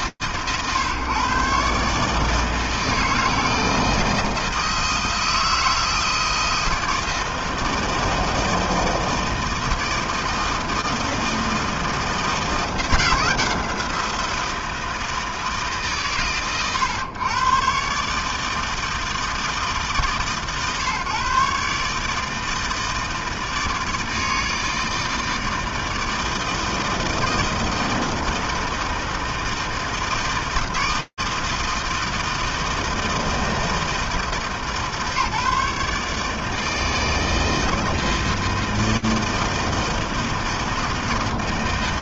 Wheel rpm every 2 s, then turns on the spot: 120, 160, 160, 160, 160, 160, 170, 170, 100, 160, 130, 160, 160, 160, 160, 160, 160, 150, 160, 160, 160.
none